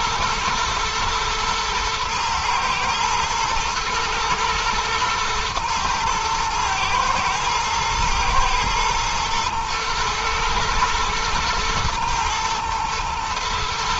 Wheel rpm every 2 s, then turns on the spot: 110, 110, 110, 110, 120, 110, 120.
none